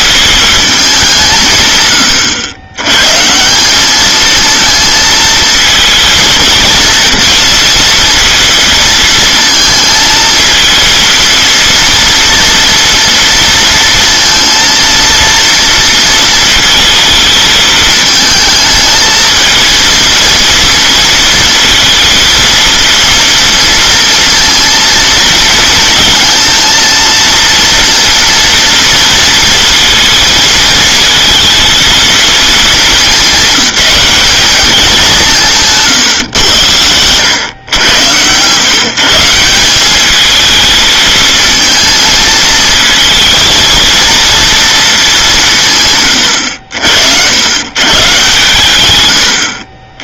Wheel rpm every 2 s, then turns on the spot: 200, 120, 220, 230, 230, 230, 230, 230, 220, 220, 230, 230, 230, 230, 230, 230, 220, 200, 110, 140, 220, 230, 220, 80, 120.
36-38